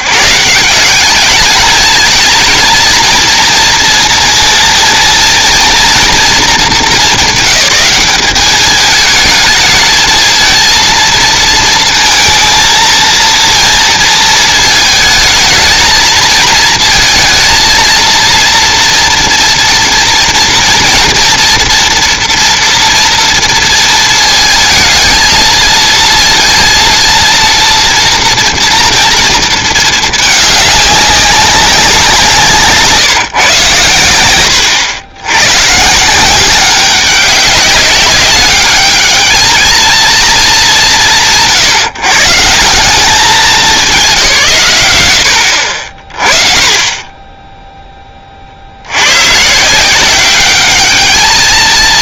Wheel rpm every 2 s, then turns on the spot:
160, 230, 230, 210, 210, 220, 230, 220, 230, 230, 230, 230, 220, 230, 230, 210, 160, 50, 190, 210, 200, 150, 130, 20, 50, 200.
none